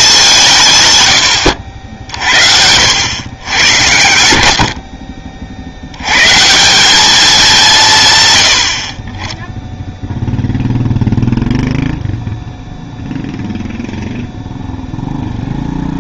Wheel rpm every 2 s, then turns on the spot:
150, 80, 60, 200, 40, 0, 0, 0.
none